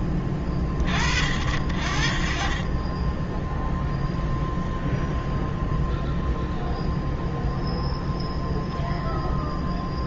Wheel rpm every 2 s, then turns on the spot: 40, 0, 0, 0, 0.
none